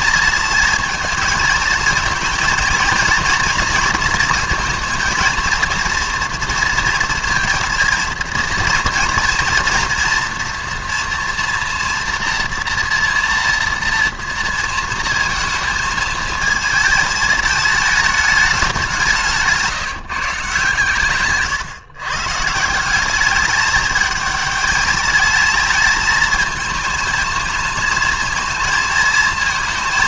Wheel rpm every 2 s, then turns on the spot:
230, 220, 230, 230, 230, 240, 230, 230, 220, 220, 160, 120, 210, 220, 220.
none